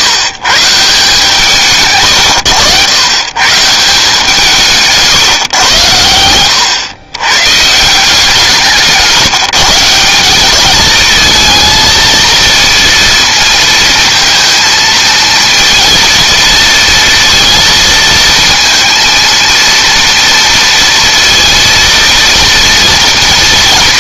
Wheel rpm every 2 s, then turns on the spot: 160, 110, 160, 110, 160, 230, 230, 230, 230, 230, 230, 220.
none